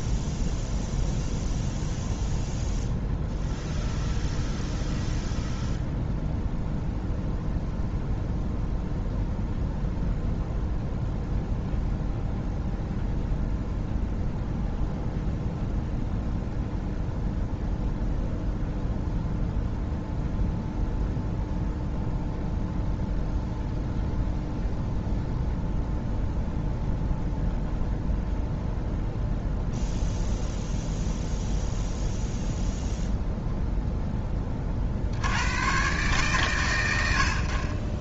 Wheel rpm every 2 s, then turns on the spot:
0, 0, 0, 0, 0, 0, 0, 0, 0, 0, 0, 0, 0, 0, 0, 0, 0, 50, 100.
none